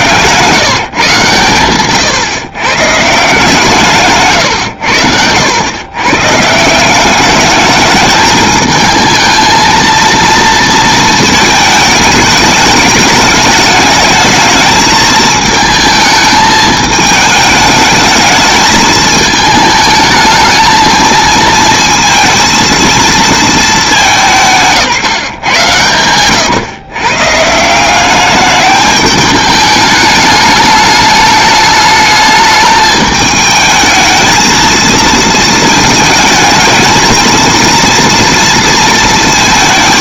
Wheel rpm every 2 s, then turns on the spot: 160, 140, 110, 170, 220, 230, 210, 220, 220, 220, 220, 230, 160, 120, 210, 210, 220, 230, 220, 230.
4-6